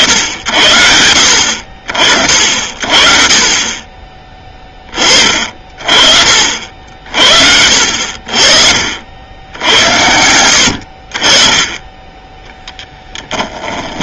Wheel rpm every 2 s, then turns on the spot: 70, 50, 20, 50, 50, 90, 10.
12-14